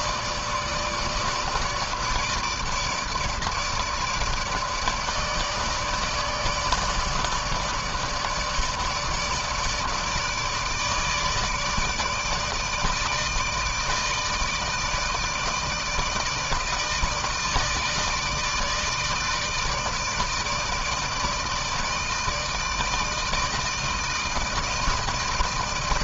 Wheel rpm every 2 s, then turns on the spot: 150, 150, 150, 160, 150, 160, 160, 160, 160, 150, 160, 160, 160.
none